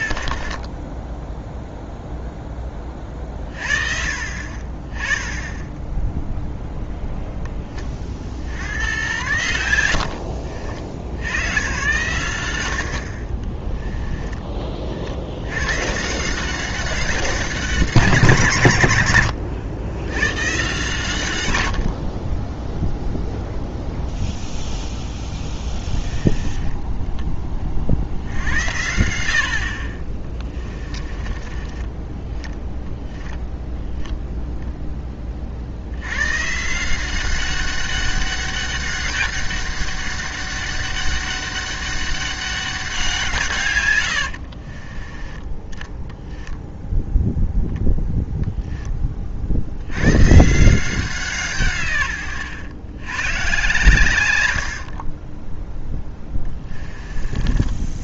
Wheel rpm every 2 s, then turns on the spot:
40, 30, 30, 0, 80, 60, 80, 50, 190, 120, 130, 0, 0, 10, 80, 20, 10, 0, 160, 200, 200, 190, 50, 0, 10, 160, 110, 80, 20.
26-28 30-34 44-46 54-58